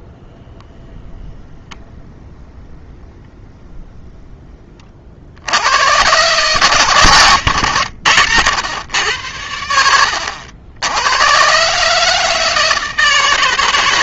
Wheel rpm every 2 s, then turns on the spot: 10, 10, 20, 150, 110, 80, 160.
none